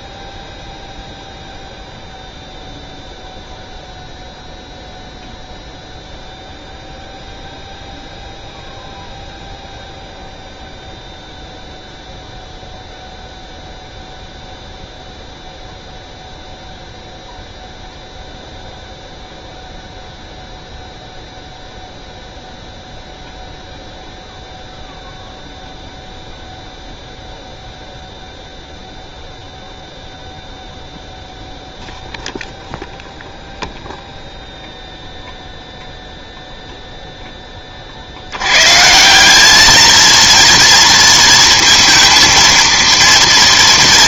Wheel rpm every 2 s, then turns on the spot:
0, 0, 0, 0, 0, 0, 0, 0, 0, 0, 0, 0, 0, 0, 0, 0, 0, 0, 0, 130, 230, 230.
none